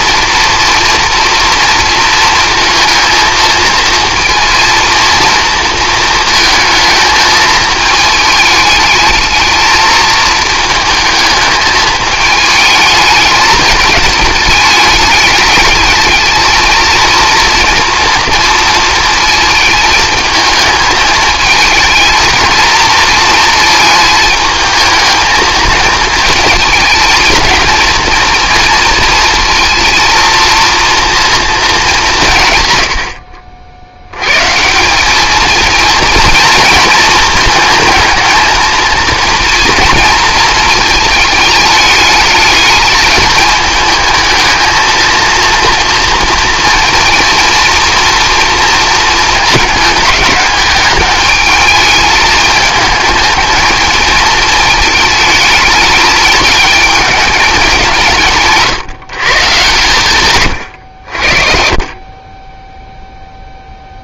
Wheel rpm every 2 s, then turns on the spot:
230, 230, 230, 220, 220, 220, 210, 210, 220, 230, 220, 230, 220, 230, 230, 230, 110, 160, 220, 220, 220, 210, 220, 230, 230, 210, 220, 220, 220, 140, 100, 10.
60-64